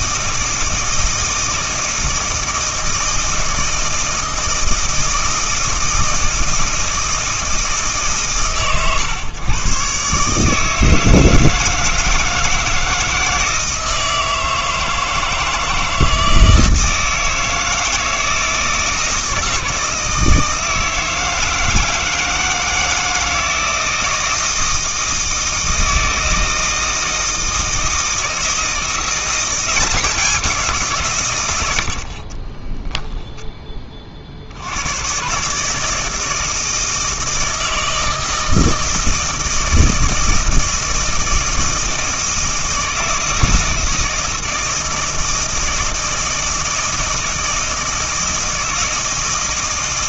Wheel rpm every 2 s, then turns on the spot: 160, 160, 160, 160, 120, 160, 160, 160, 160, 160, 160, 160, 160, 160, 170, 170, 10, 100, 160, 160, 160, 160, 160, 160, 160.
32-34